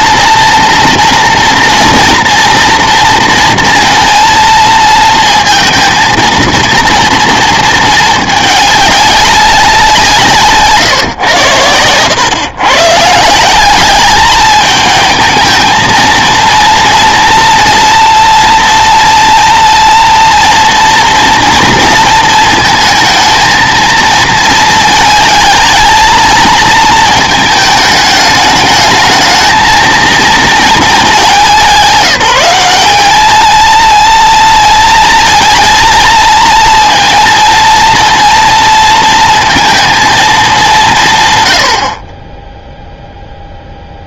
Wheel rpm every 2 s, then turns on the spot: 230, 230, 230, 230, 210, 150, 130, 210, 230, 230, 230, 220, 220, 220, 220, 220, 200, 230, 230, 230, 170, 0.
10-12